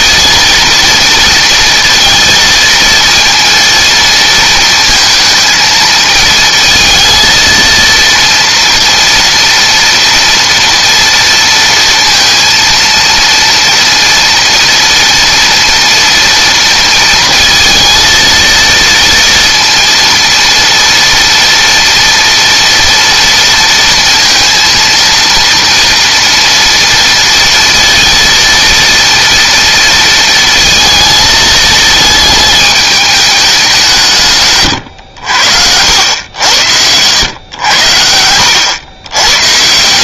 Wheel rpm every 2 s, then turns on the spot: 230, 230, 230, 230, 230, 230, 230, 230, 230, 230, 230, 230, 230, 230, 230, 230, 220, 120, 90, 110.
none